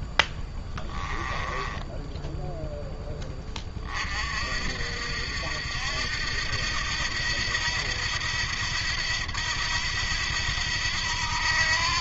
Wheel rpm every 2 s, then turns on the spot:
10, 10, 50, 80, 80, 80.
0-2